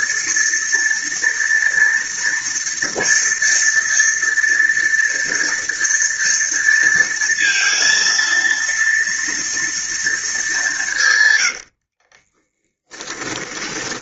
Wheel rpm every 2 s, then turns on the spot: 230, 230, 230, 230, 230, 220, 30.
12-14